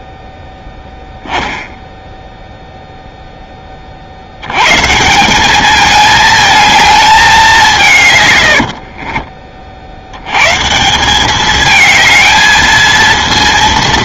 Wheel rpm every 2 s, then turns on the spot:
10, 0, 130, 220, 80, 140, 220.
8-10